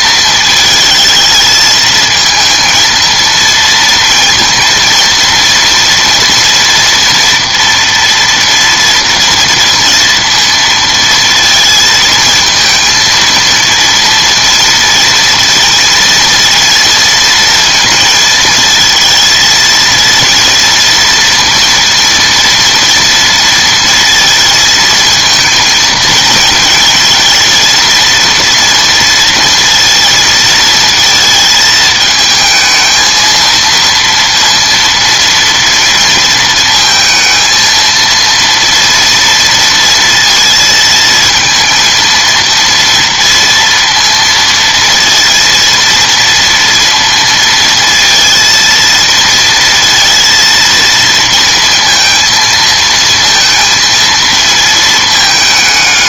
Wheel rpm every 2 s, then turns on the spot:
220, 230, 230, 230, 230, 230, 220, 230, 230, 220, 230, 230, 230, 220, 230, 230, 220, 230, 230, 230, 230, 230, 230, 230, 230, 230, 230, 230.
none